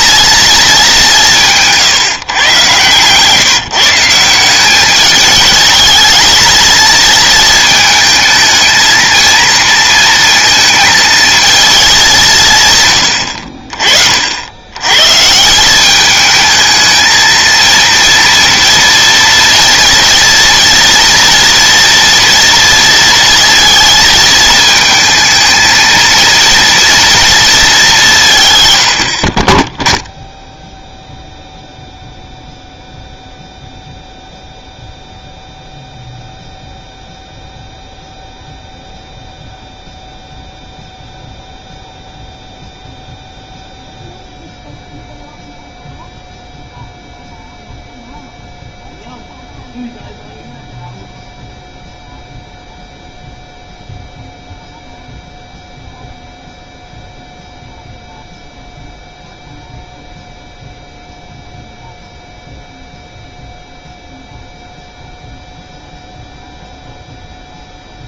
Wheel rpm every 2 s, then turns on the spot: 220, 130, 180, 230, 220, 230, 150, 90, 220, 230, 230, 230, 220, 230, 130, 0, 0, 0, 0, 0, 0, 0, 0, 0, 0, 0, 0, 0, 0, 0, 0, 0, 0, 0.
none